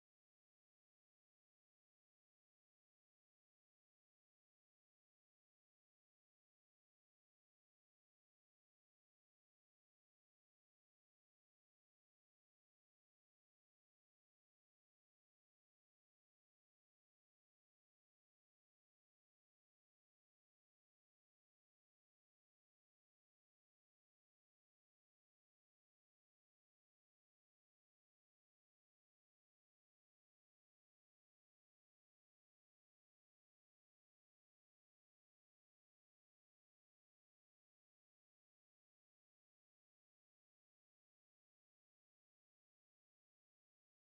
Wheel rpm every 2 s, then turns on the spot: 0, 0, 0, 0, 0, 0, 0, 0, 0, 0, 0, 0, 0, 0, 0, 0, 0, 0, 0, 0, 0, 0.
none